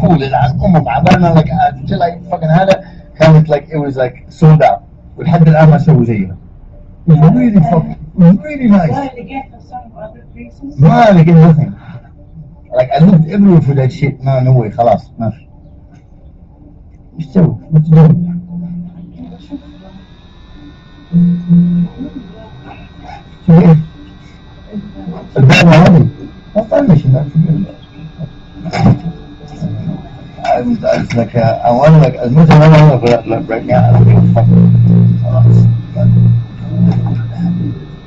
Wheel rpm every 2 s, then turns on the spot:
0, 0, 0, 0, 0, 0, 0, 0, 0, 0, 0, 0, 0, 0, 0, 0, 0, 0, 0.
none